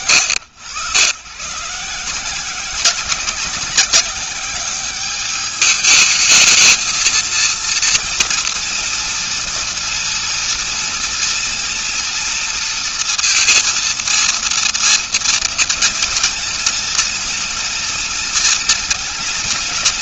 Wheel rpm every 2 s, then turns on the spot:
110, 180, 200, 220, 230, 230, 230, 230, 230, 230.
none